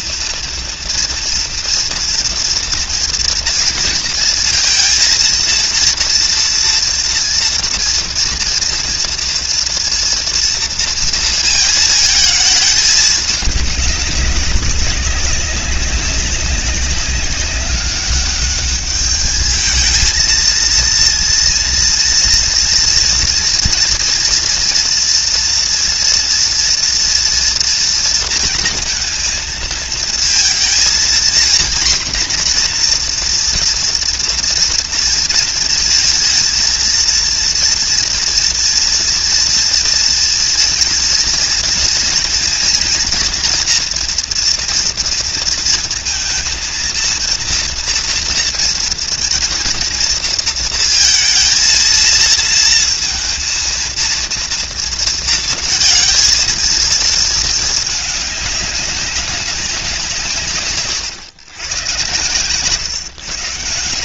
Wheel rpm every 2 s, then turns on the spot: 230, 230, 230, 230, 240, 230, 210, 190, 200, 210, 230, 240, 230, 230, 230, 230, 240, 240, 230, 230, 230, 230, 240, 230, 230, 220, 230, 230, 230, 200, 130, 130.
none